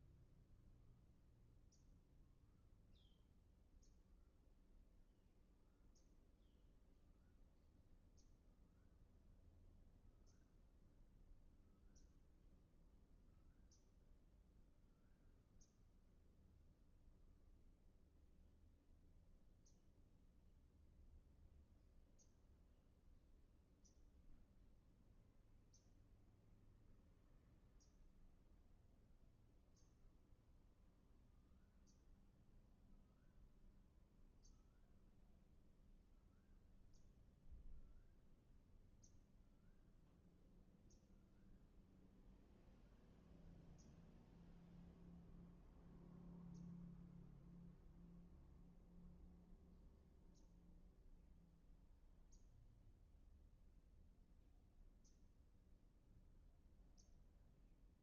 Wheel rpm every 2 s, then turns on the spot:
0, 0, 0, 0, 0, 0, 0, 0, 0, 0, 0, 0, 0, 0, 0, 0, 0, 0, 0, 0, 0, 0, 0, 0, 0, 0, 0, 0, 0.
none